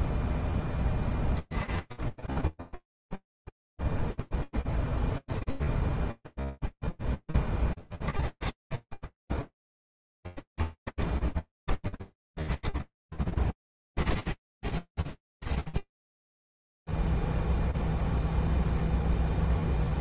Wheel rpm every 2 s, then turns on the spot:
10, 0, 10, 0, 30, 30, 10, 10, 0, 0.
none